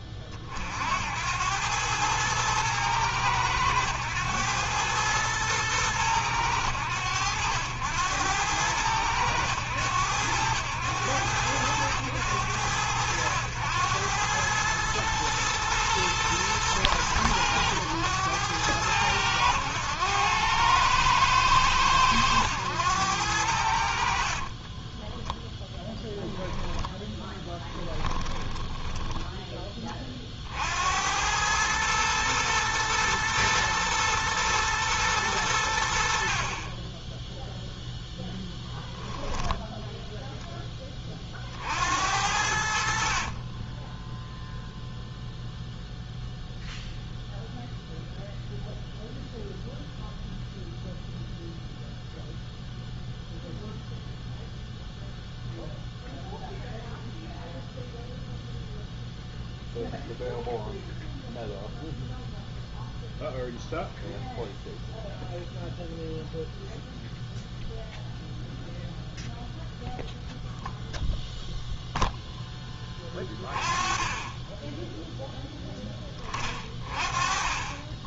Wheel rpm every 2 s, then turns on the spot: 20, 110, 110, 100, 90, 90, 100, 100, 110, 100, 100, 100, 40, 10, 10, 40, 110, 120, 60, 0, 0, 60, 0, 0, 0, 0, 0, 0, 0, 0, 0, 0, 0, 0, 0, 0, 0, 20, 20.
24-30